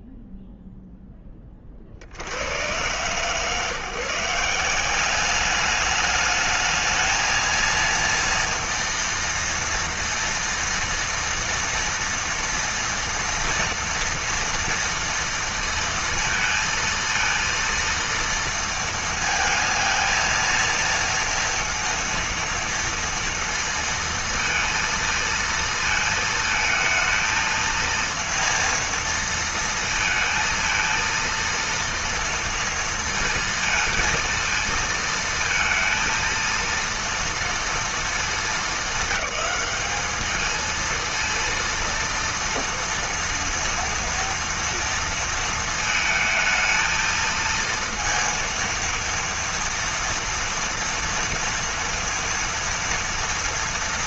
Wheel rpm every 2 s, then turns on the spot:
0, 120, 190, 220, 230, 230, 230, 230, 230, 230, 230, 230, 230, 220, 230, 230, 230, 230, 230, 220, 230, 230, 230, 220, 230, 230, 230.
none